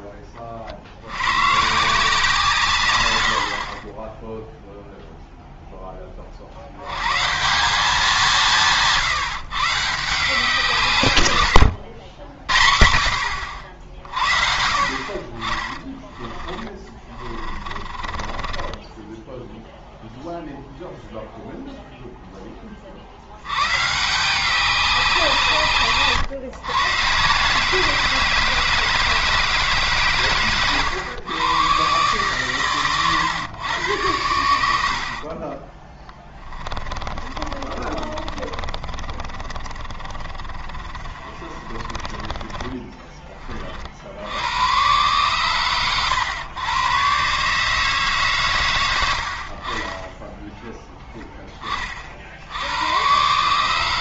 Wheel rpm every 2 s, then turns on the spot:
40, 140, 0, 70, 160, 170, 70, 50, 30, 20, 0, 20, 180, 120, 160, 130, 130, 80, 20, 30, 30, 20, 90, 110, 120, 10, 80.
16-20 36-42